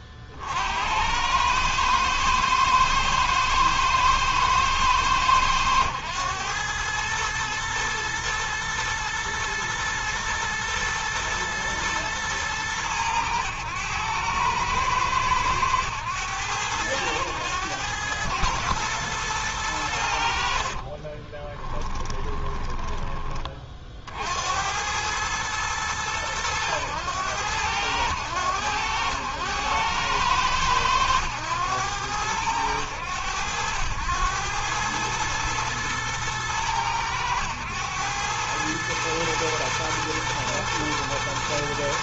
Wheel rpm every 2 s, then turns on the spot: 40, 110, 110, 110, 110, 110, 110, 110, 110, 110, 70, 20, 70, 110, 90, 100, 100, 100, 110, 100, 120.
20-22